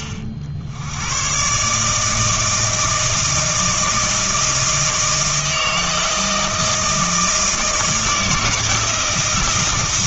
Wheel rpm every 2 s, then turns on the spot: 70, 160, 160, 160, 160.
none